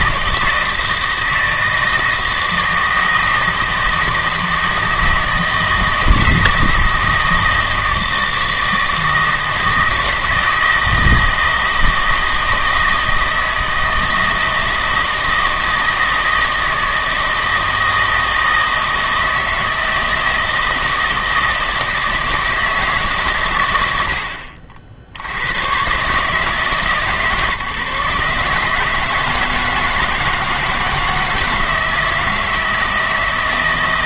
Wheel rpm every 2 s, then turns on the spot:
160, 160, 160, 160, 160, 160, 160, 160, 160, 160, 160, 160, 50, 150, 160, 160, 160.
none